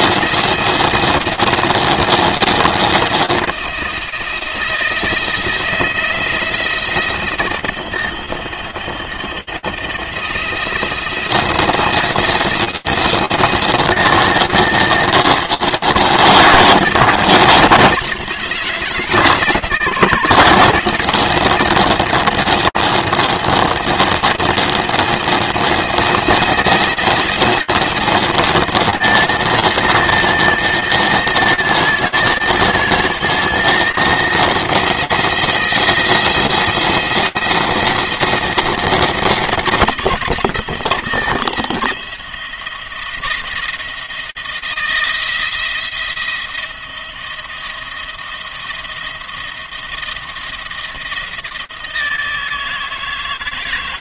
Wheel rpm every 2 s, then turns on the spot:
170, 170, 170, 170, 170, 170, 160, 160, 160, 160, 160, 170, 170, 160, 170, 160, 160, 170, 170, 170, 160, 170, 170, 170, 170, 170, 160.
none